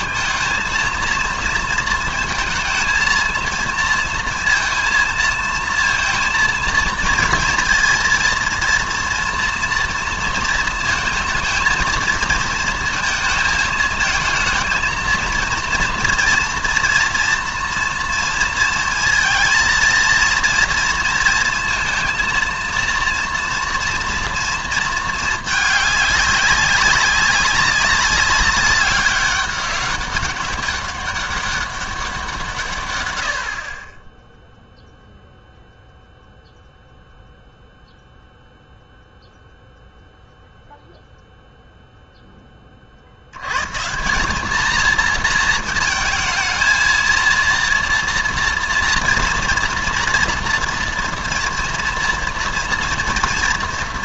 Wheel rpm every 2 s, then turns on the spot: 230, 230, 220, 230, 230, 220, 220, 230, 230, 230, 230, 230, 230, 190, 200, 200, 140, 0, 0, 0, 0, 30, 220, 220, 230, 230, 240.
none